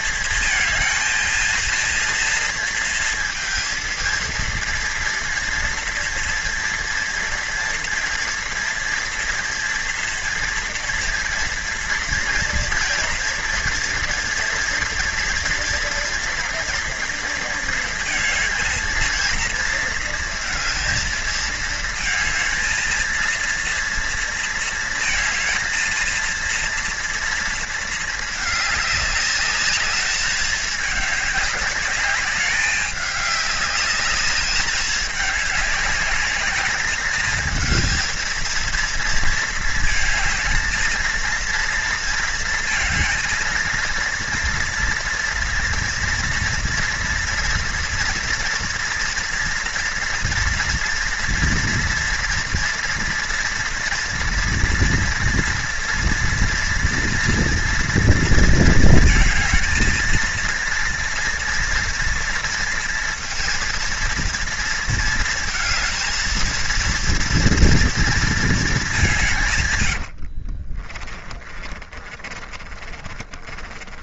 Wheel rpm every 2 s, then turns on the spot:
230, 230, 230, 230, 240, 230, 230, 230, 230, 230, 230, 230, 230, 230, 210, 210, 210, 210, 220, 230, 230, 220, 230, 230, 240, 230, 230, 230, 230, 230, 230, 230, 230, 230, 200, 30, 30.
70-74